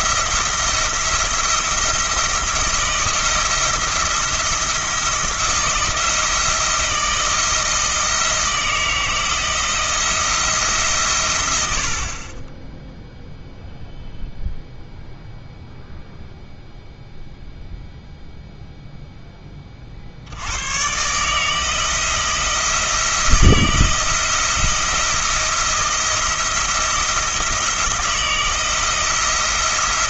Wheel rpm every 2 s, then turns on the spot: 170, 170, 170, 160, 160, 150, 0, 0, 0, 0, 120, 160, 170, 170, 160.
none